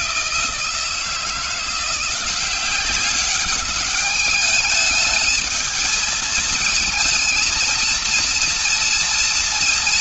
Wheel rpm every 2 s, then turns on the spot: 160, 180, 210, 220, 230.
none